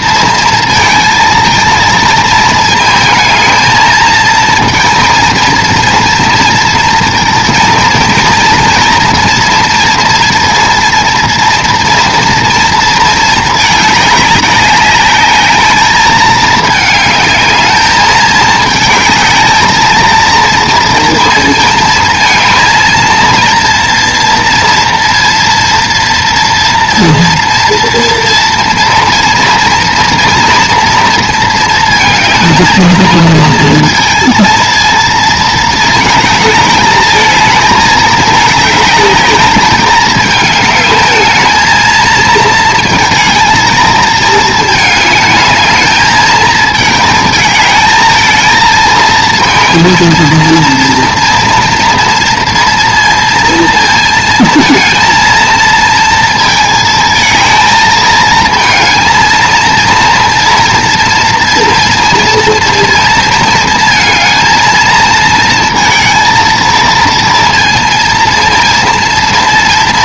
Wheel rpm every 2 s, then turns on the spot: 230, 220, 230, 230, 230, 230, 230, 210, 220, 220, 230, 230, 230, 240, 230, 230, 220, 230, 220, 210, 220, 220, 220, 220, 230, 230, 230, 230, 220, 220, 230, 230, 230, 230, 230.
none